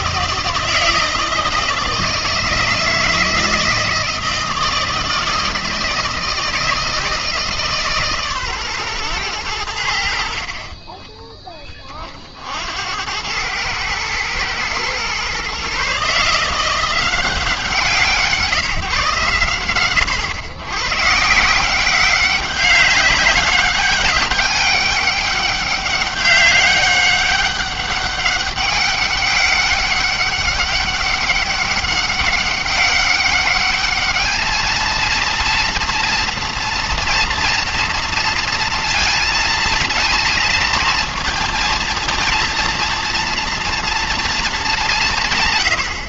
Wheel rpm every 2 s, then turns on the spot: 160, 160, 160, 160, 130, 50, 60, 120, 170, 160, 110, 190, 200, 200, 200, 200, 200, 220, 230, 230, 230, 230, 220.
none